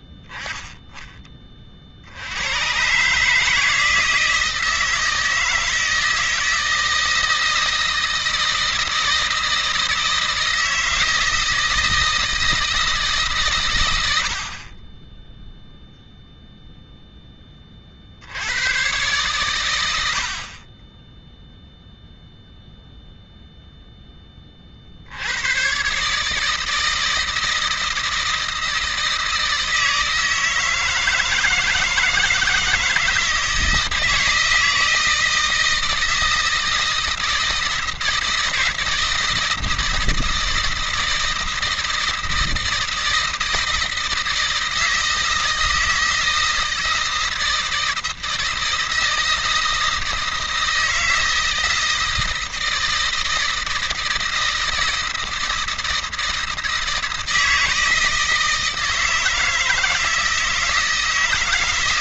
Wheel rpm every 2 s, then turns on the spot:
10, 110, 160, 160, 160, 160, 160, 60, 0, 90, 40, 0, 30, 150, 160, 160, 160, 160, 160, 160, 160, 160, 160, 160, 160, 160, 160, 160, 160, 160, 160.
none